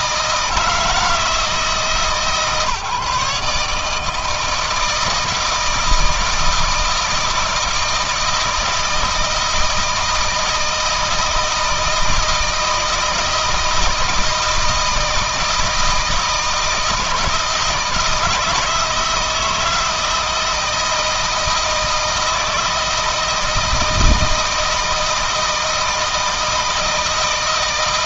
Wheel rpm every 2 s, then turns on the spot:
160, 150, 160, 160, 160, 160, 160, 160, 160, 160, 160, 160, 160, 160.
none